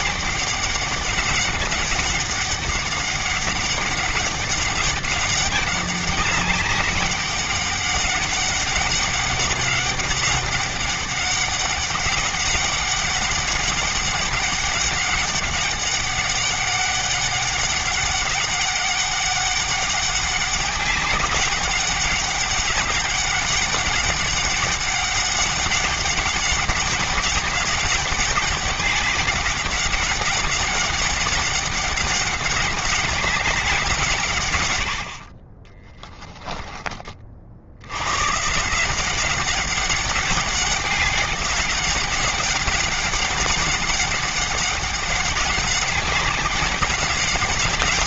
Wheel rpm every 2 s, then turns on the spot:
200, 200, 200, 200, 190, 200, 200, 200, 200, 200, 190, 200, 200, 200, 200, 200, 190, 130, 10, 140, 200, 190, 200, 200.
none